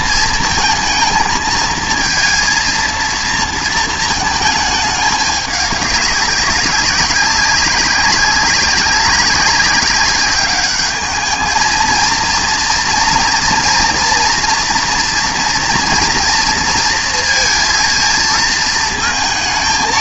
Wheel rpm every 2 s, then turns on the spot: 230, 230, 210, 190, 200, 210, 230, 230, 230, 230.
none